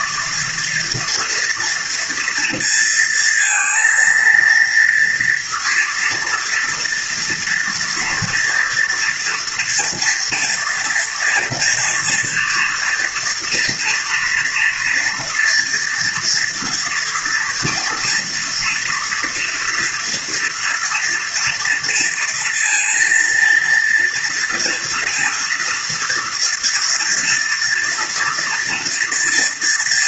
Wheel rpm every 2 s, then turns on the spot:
230, 230, 230, 230, 230, 230, 230, 230, 230, 230, 230, 230, 230, 230, 230.
none